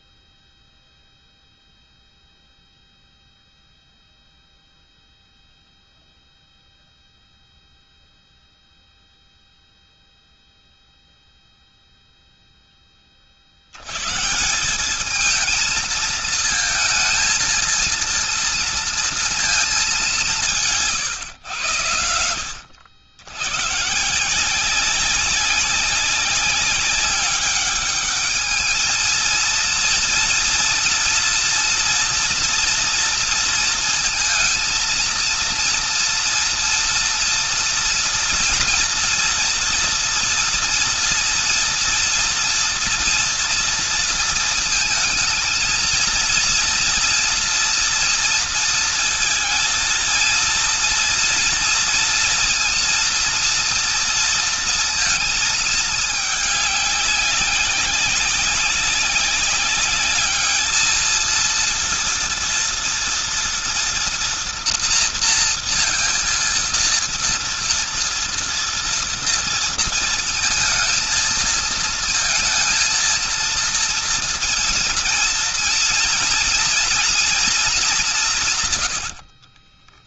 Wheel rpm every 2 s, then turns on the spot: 0, 0, 0, 0, 0, 0, 30, 200, 230, 230, 140, 90, 200, 200, 220, 230, 230, 230, 230, 230, 230, 230, 220, 230, 230, 230, 230, 230, 200, 200, 220, 230, 230, 230, 230, 230, 230, 230, 230, 100.
78-80